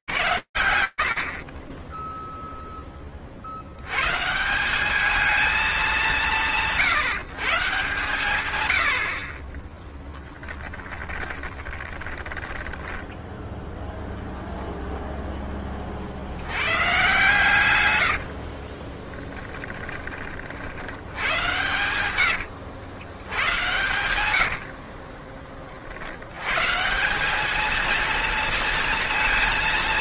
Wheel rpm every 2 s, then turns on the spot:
110, 20, 150, 170, 130, 10, 10, 0, 120, 20, 80, 90, 50, 170, 230.
10-14 18-20 24-26